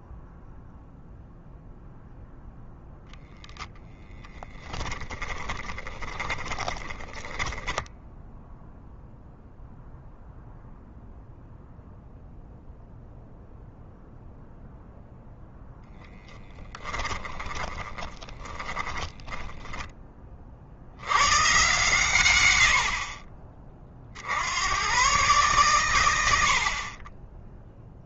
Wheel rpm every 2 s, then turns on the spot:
0, 0, 10, 20, 0, 0, 0, 0, 10, 30, 100, 70, 110, 40.
4-8 16-20